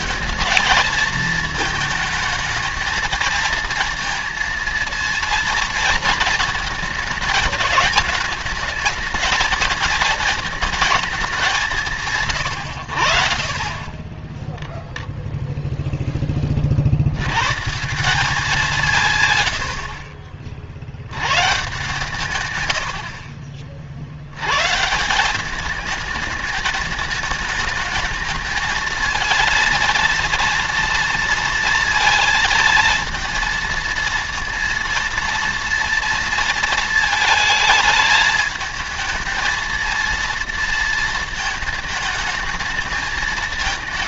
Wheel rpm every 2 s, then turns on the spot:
220, 220, 230, 220, 210, 220, 80, 0, 60, 170, 80, 90, 150, 210, 220, 230, 220, 230, 220, 220, 230, 220.
none